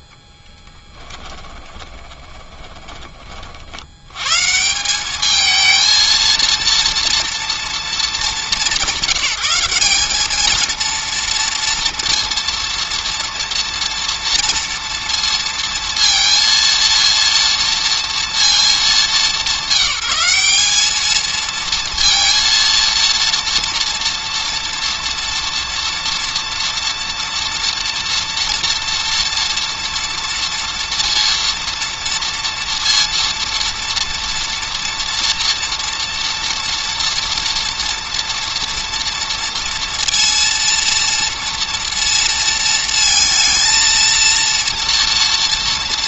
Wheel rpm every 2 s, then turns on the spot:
20, 20, 160, 230, 190, 230, 230, 230, 230, 220, 190, 230, 230, 230, 230, 230, 230, 230, 230, 240, 230, 230, 230.
0-4